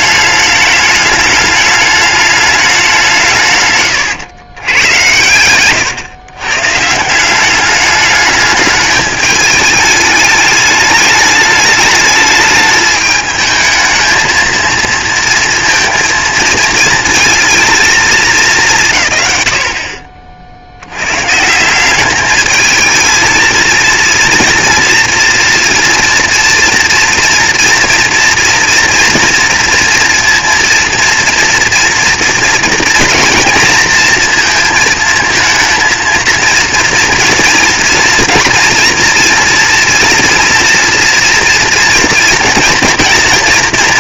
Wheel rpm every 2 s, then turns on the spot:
210, 210, 120, 130, 210, 210, 220, 230, 230, 190, 60, 210, 230, 240, 230, 230, 230, 230, 230, 240, 230, 230.
none